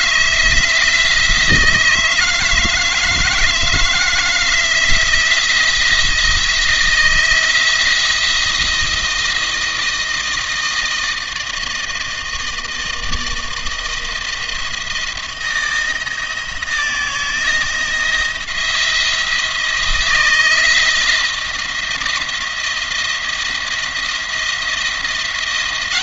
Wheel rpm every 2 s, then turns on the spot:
160, 160, 170, 160, 160, 160, 160, 160, 160, 170, 160, 170, 170.
none